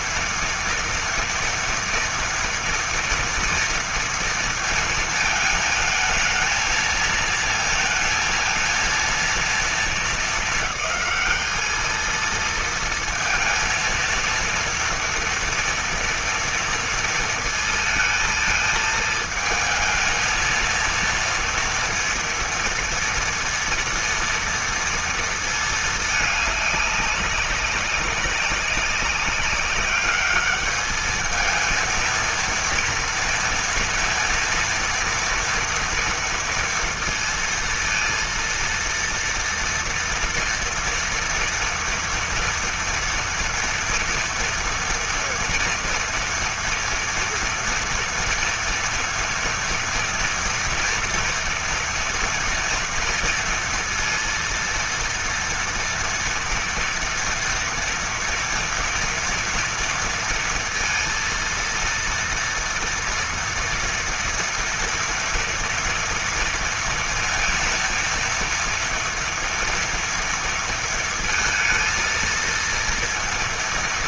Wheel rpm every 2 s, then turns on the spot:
230, 240, 230, 220, 230, 210, 230, 230, 230, 220, 230, 230, 230, 200, 200, 210, 230, 230, 230, 230, 230, 230, 230, 230, 240, 230, 230, 230, 230, 230, 230, 230, 230, 230, 230, 230, 230.
none